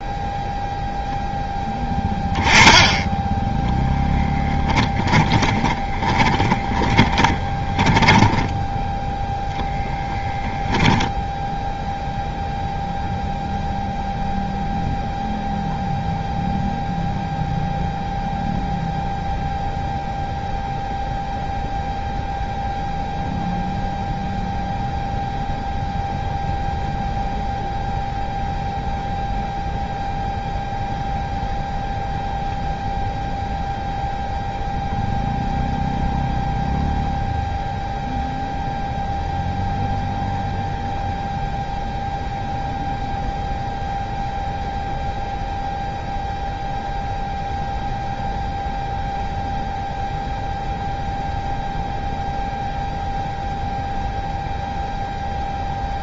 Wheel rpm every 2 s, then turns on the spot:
0, 10, 20, 20, 0, 10, 0, 0, 0, 0, 0, 0, 0, 0, 0, 0, 0, 0, 0, 0, 0, 0, 0, 0, 0, 0, 0, 0.
4-8